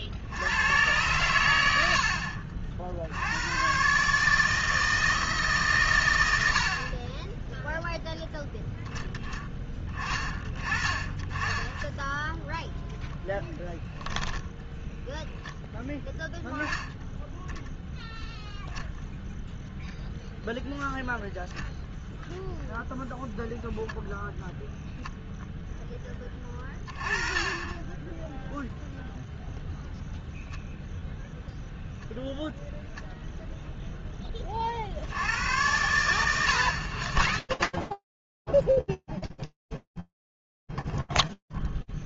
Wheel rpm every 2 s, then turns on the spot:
100, 90, 150, 10, 20, 20, 10, 10, 0, 0, 0, 0, 0, 20, 10, 0, 0, 70, 110, 10, 0.
none